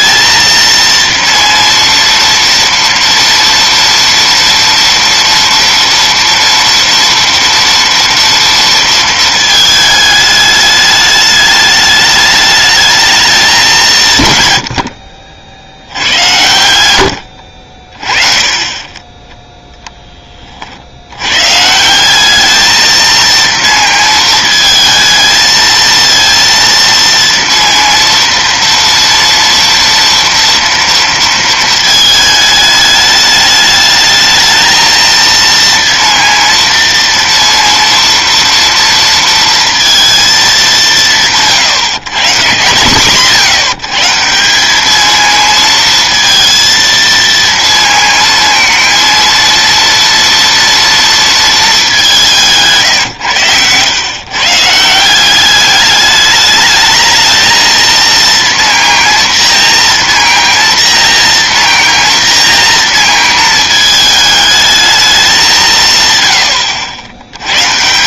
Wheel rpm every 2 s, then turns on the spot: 230, 240, 230, 230, 230, 210, 220, 100, 90, 20, 60, 220, 220, 230, 230, 230, 210, 220, 230, 230, 200, 140, 210, 230, 230, 230, 140, 160, 210, 230, 230, 230, 220, 90.
none